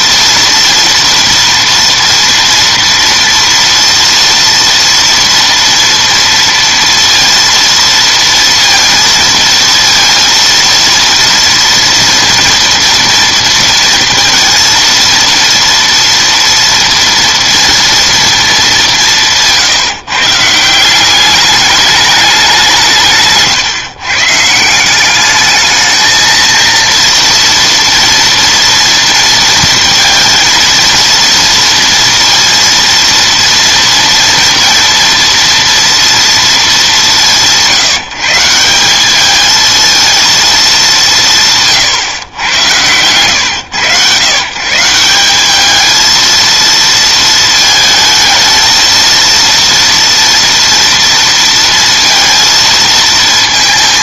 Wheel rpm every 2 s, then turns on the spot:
230, 230, 230, 230, 230, 230, 230, 230, 230, 200, 170, 170, 170, 230, 230, 230, 230, 230, 210, 180, 220, 100, 150, 230, 220, 230, 230.
none